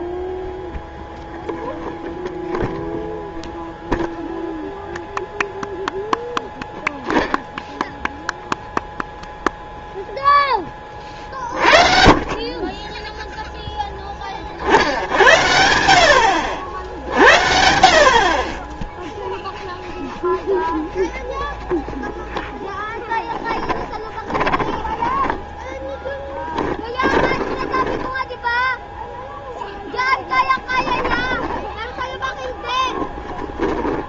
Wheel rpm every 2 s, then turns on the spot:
0, 0, 0, 0, 0, 20, 30, 50, 70, 20, 0, 0, 20, 10, 0, 10, 20.
24-28 32-34